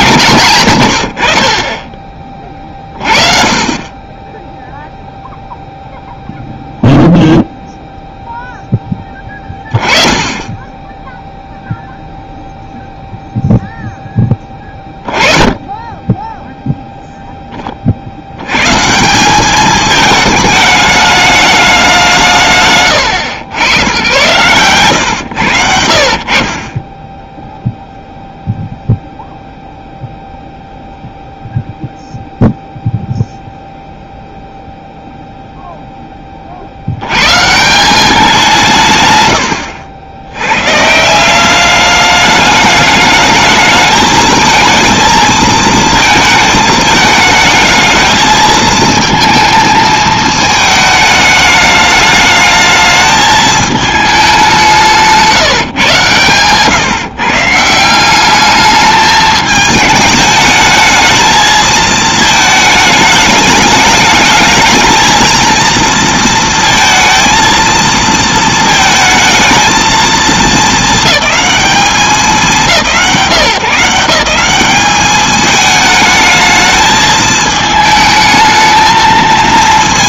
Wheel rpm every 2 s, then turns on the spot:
90, 30, 0, 0, 10, 10, 0, 20, 0, 150, 210, 130, 130, 20, 0, 0, 0, 0, 60, 160, 150, 210, 220, 220, 220, 220, 220, 180, 140, 210, 210, 220, 220, 230, 220, 220, 190, 200, 220, 220.
none